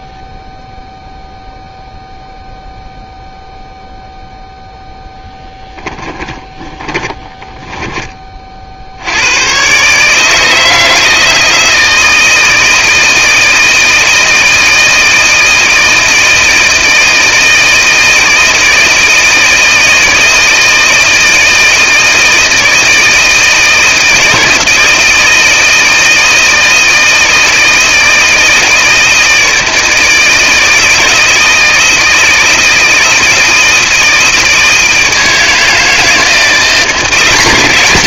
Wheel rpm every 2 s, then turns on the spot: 0, 0, 10, 20, 70, 160, 160, 160, 160, 160, 160, 160, 160, 160, 160, 160, 160, 160, 170.
6-8